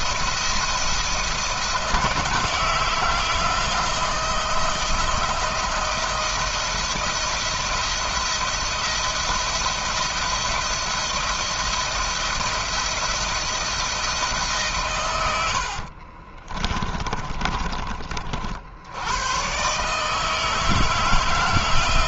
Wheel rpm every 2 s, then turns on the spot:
170, 160, 160, 170, 170, 170, 170, 130, 20, 80, 160.
16-18